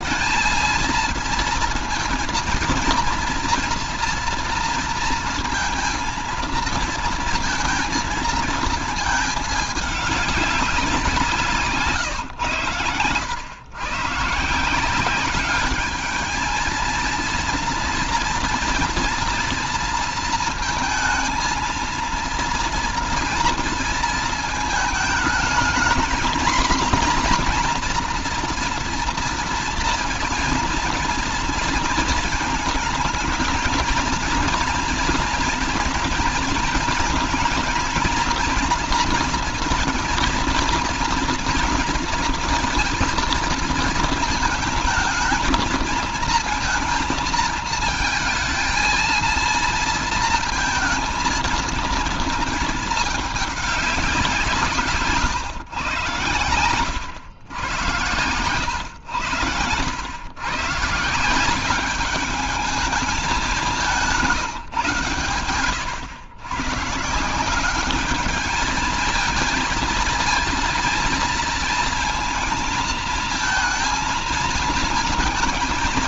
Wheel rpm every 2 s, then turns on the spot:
220, 230, 230, 230, 220, 190, 100, 180, 220, 230, 230, 230, 220, 240, 240, 230, 220, 230, 230, 230, 230, 230, 230, 230, 220, 230, 220, 160, 110, 110, 160, 210, 140, 130, 220, 230, 220, 220.
none